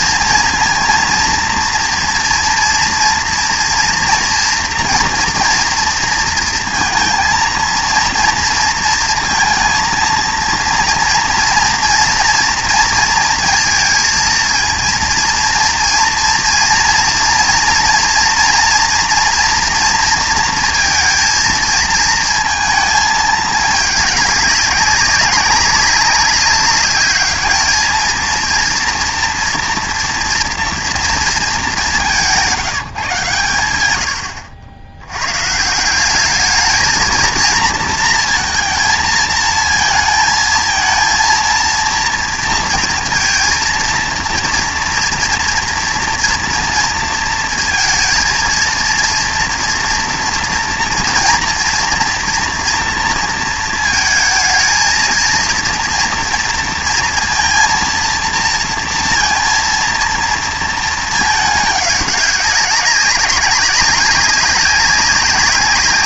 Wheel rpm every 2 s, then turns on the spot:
230, 240, 240, 230, 230, 230, 230, 230, 230, 230, 230, 220, 200, 200, 230, 230, 170, 90, 220, 230, 220, 230, 230, 230, 230, 230, 230, 220, 230, 230, 220, 200, 200.
none